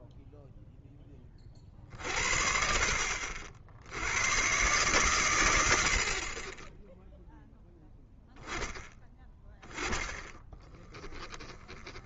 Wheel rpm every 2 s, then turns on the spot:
0, 50, 130, 20, 10, 20.
10-12